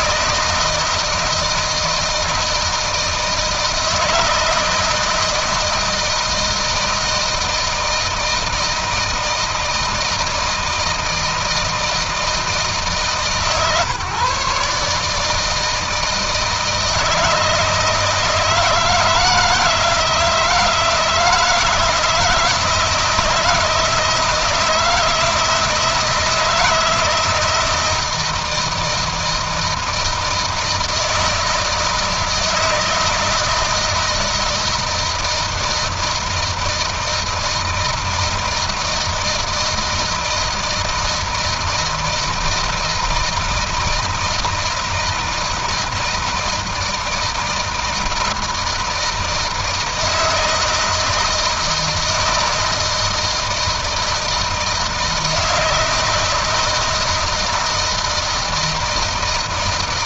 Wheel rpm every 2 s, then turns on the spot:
160, 160, 160, 160, 160, 160, 160, 150, 160, 160, 160, 170, 160, 160, 160, 160, 160, 160, 160, 160, 160, 160, 160, 160, 160, 160, 160, 160, 160, 160.
none